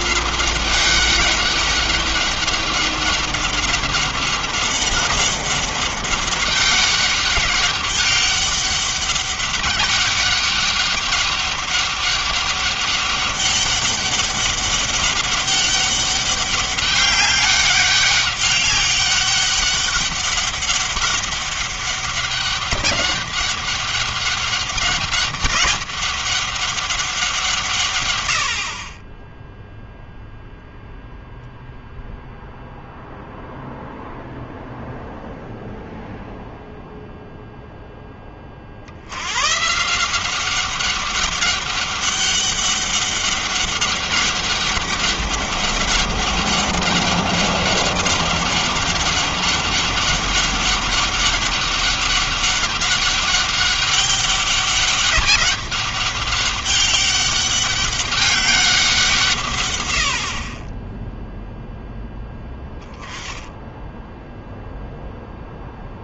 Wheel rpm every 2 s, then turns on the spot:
200, 190, 190, 200, 200, 200, 200, 200, 200, 200, 200, 200, 200, 180, 30, 0, 0, 0, 0, 90, 200, 200, 200, 200, 200, 200, 200, 200, 200, 170, 10, 10, 0.
none